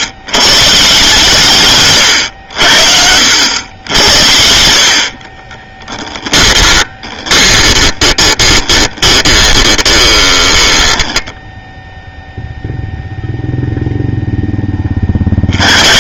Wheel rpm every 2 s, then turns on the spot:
130, 70, 70, 10, 20, 10, 0, 10.
6-12